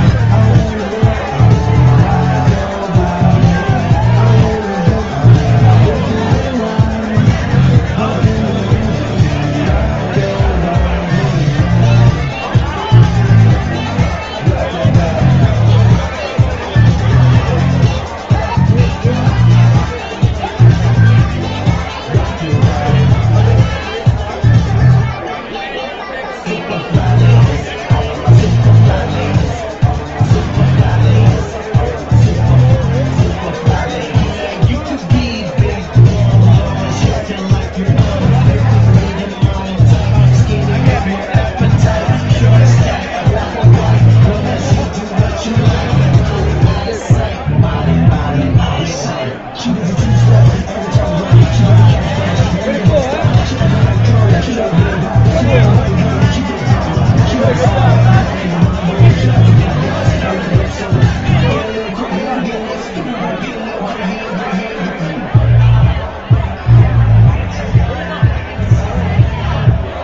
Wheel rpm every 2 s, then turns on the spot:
0, 0, 0, 0, 0, 0, 0, 0, 0, 0, 0, 0, 0, 0, 0, 0, 0, 0, 0, 0, 0, 0, 0, 0, 0, 0, 0, 0, 0, 0, 0, 0, 0, 0, 0.
none